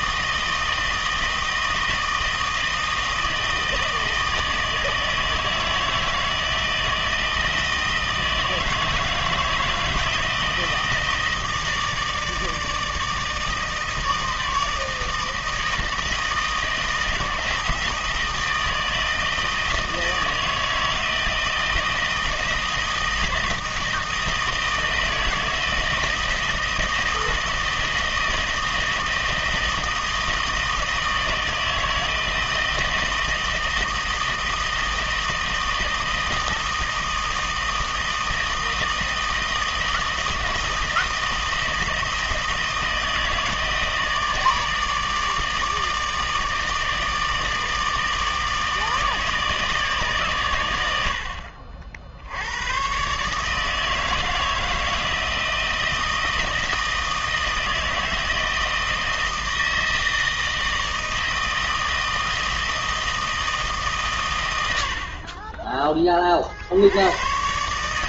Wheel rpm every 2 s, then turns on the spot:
160, 160, 160, 160, 160, 160, 160, 160, 160, 160, 160, 160, 160, 160, 160, 160, 160, 160, 160, 160, 160, 160, 160, 160, 160, 120, 80, 160, 160, 160, 160, 160, 110, 50.
none